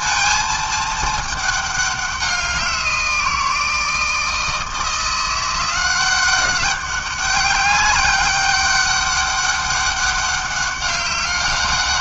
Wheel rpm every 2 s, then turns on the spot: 220, 180, 170, 190, 200, 200.
none